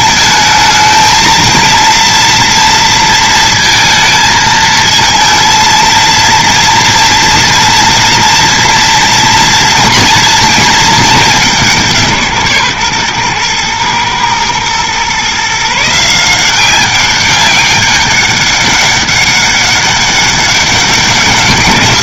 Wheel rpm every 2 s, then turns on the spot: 220, 230, 220, 230, 230, 220, 140, 120, 180, 200, 200.
none